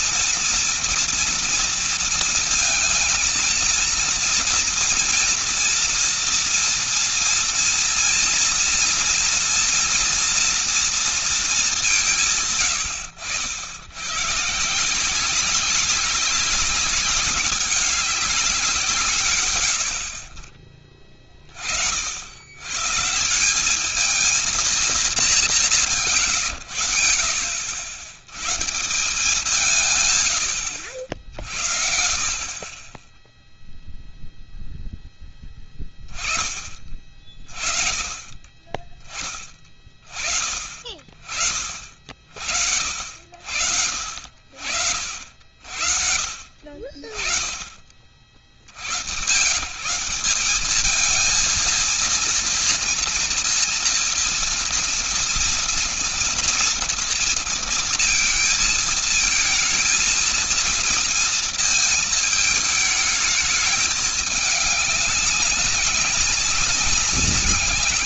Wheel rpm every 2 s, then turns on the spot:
230, 230, 230, 230, 230, 240, 140, 140, 200, 200, 60, 100, 230, 120, 120, 100, 30, 0, 30, 30, 40, 60, 60, 50, 60, 200, 230, 230, 230, 230, 230, 220, 200, 190.
none